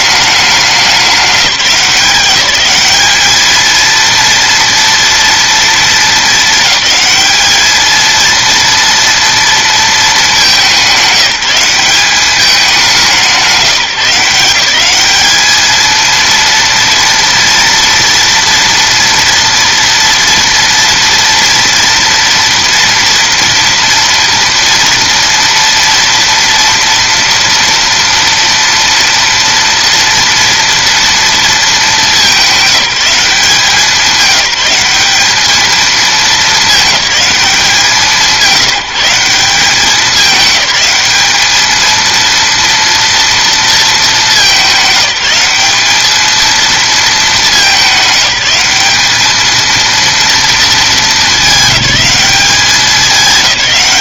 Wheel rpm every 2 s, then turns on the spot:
200, 200, 230, 210, 230, 200, 200, 190, 230, 230, 230, 240, 230, 230, 230, 230, 200, 190, 210, 170, 210, 230, 200, 230, 210, 220, 190.
none